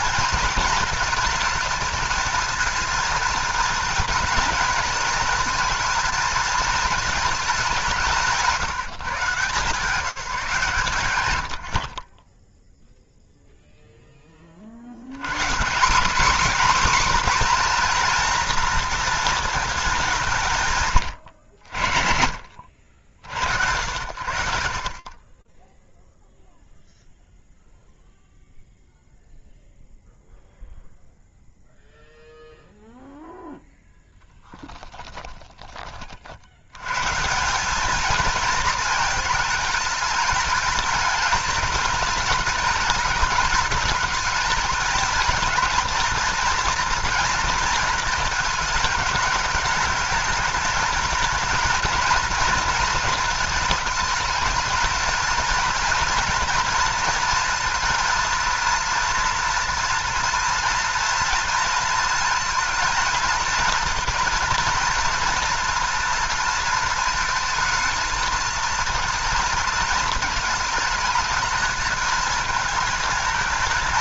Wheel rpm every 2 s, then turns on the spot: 220, 230, 220, 230, 160, 150, 0, 100, 270, 230, 120, 70, 30, 0, 0, 0, 0, 20, 180, 220, 220, 220, 220, 220, 210, 230, 220, 230, 230, 230, 230, 230, 240, 220, 230, 220, 220.
34-36